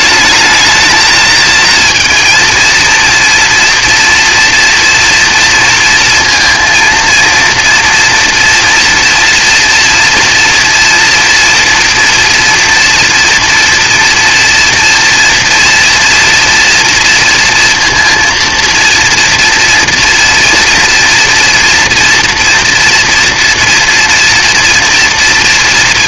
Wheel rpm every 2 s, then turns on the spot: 230, 230, 230, 230, 230, 230, 230, 230, 230, 230, 240, 230, 230.
none